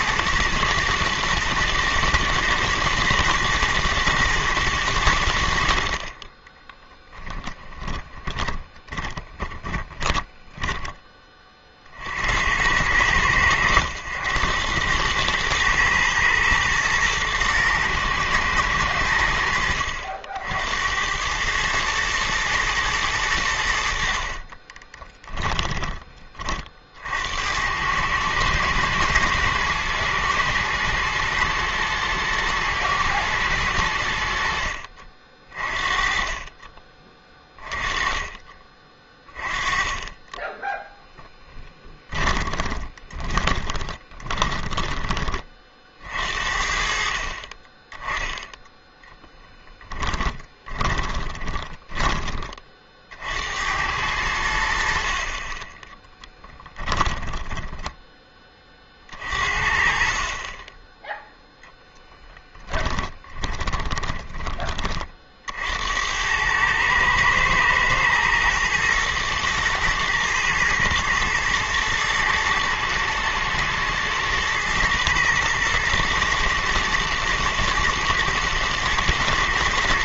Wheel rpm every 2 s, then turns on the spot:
120, 110, 110, 10, 20, 10, 80, 90, 110, 110, 70, 110, 30, 40, 110, 110, 110, 60, 30, 30, 10, 20, 20, 50, 10, 10, 30, 70, 10, 20, 20, 20, 30, 110, 110, 110, 110, 110, 120, 120.
6-12 24-26 42-46 50-52 56-58 62-64